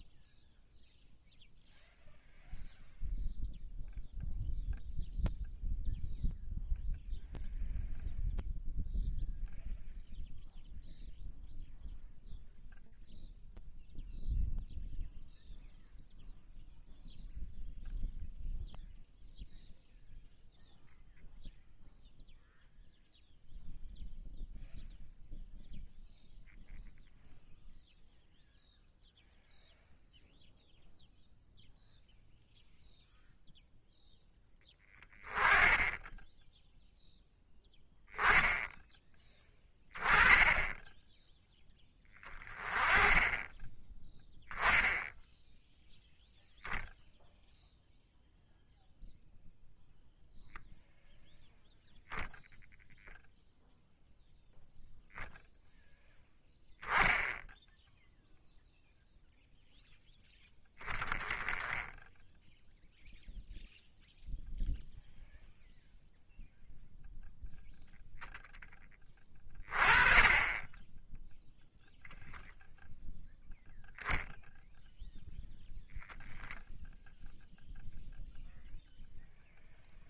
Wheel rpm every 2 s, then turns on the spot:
0, 0, 0, 0, 0, 0, 0, 0, 0, 0, 0, 0, 0, 0, 0, 0, 0, 10, 0, 10, 10, 20, 10, 0, 0, 0, 0, 0, 10, 0, 0, 0, 0, 0, 10, 20, 0, 0, 0, 0.
none